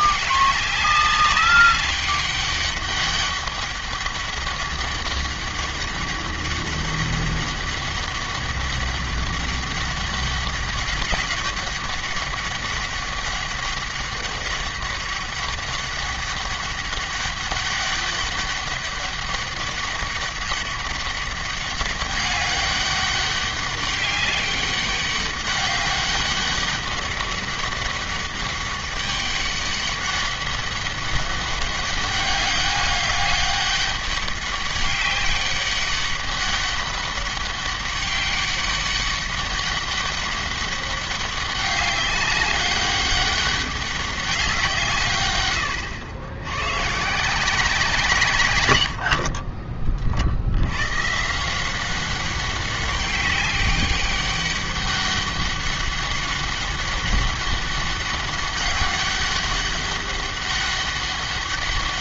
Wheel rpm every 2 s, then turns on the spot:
200, 200, 200, 200, 200, 190, 200, 200, 200, 200, 200, 200, 200, 200, 200, 200, 200, 200, 200, 200, 200, 200, 160, 130, 100, 110, 200, 200, 200, 200, 200.
none